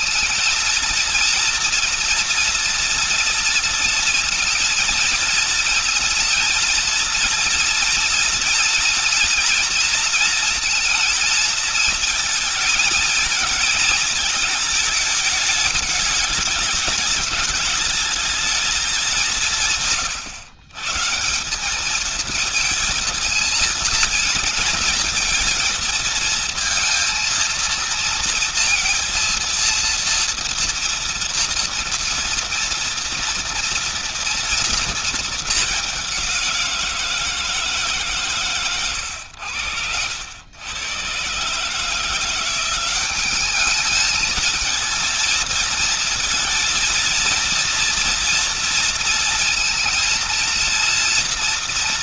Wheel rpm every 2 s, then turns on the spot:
230, 230, 230, 230, 230, 230, 230, 220, 210, 220, 130, 220, 230, 230, 230, 230, 240, 230, 180, 120, 90, 180, 220, 230, 230, 230.
none